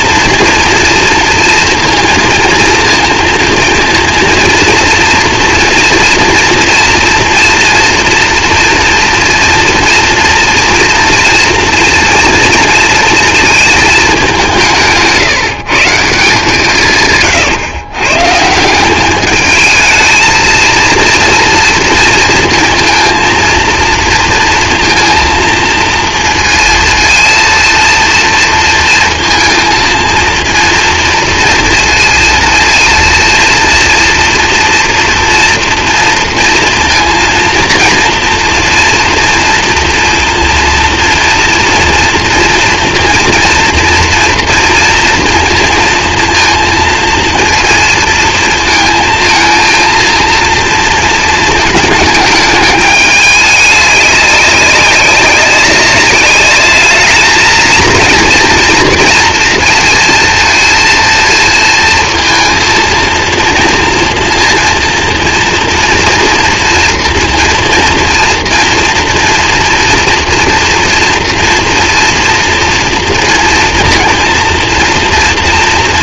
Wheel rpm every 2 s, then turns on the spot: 230, 230, 230, 240, 240, 230, 230, 180, 160, 170, 230, 230, 230, 230, 230, 230, 230, 230, 230, 230, 230, 230, 230, 230, 220, 230, 210, 200, 210, 230, 230, 230, 230, 230, 230, 230, 230, 230.
none